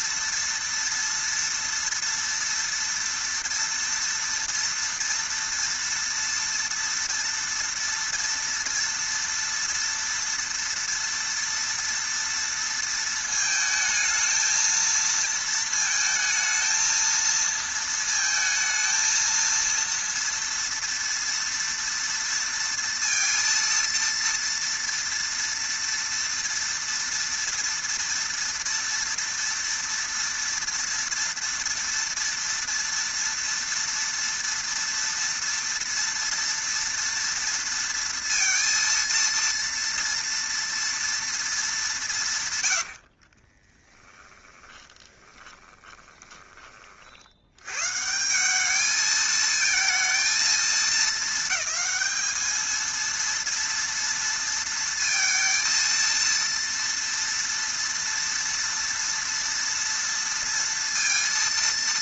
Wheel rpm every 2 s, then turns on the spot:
230, 230, 230, 230, 230, 230, 230, 220, 220, 220, 230, 230, 230, 230, 230, 230, 230, 230, 230, 230, 230, 120, 20, 20, 200, 220, 220, 230, 230, 230, 230.
44-46